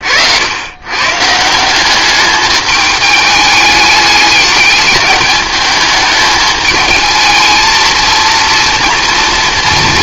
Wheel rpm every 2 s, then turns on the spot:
100, 210, 210, 210, 230.
none